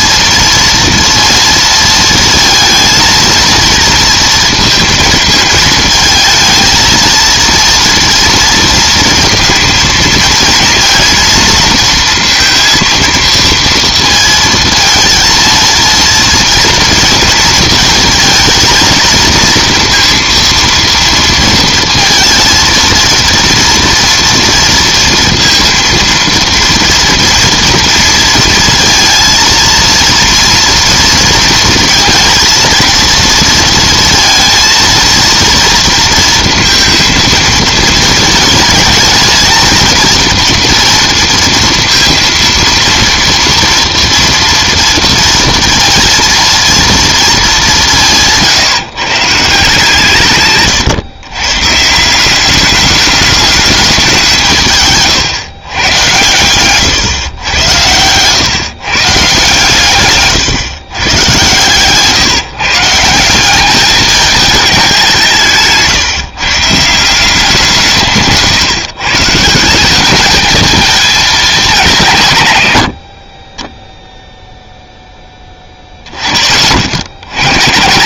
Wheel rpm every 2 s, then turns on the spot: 230, 230, 230, 220, 230, 230, 230, 230, 230, 230, 230, 230, 230, 230, 230, 230, 230, 230, 230, 220, 230, 230, 230, 230, 150, 130, 200, 150, 120, 130, 130, 140, 210, 150, 150, 220, 110, 0, 40.
50-52 56-58